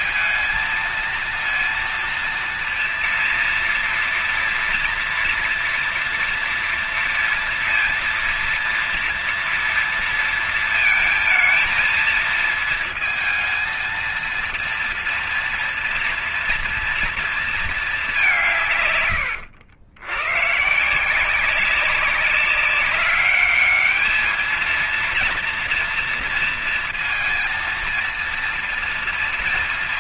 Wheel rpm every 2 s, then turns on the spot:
230, 230, 230, 230, 230, 230, 220, 230, 230, 180, 120, 190, 220, 230, 230.
none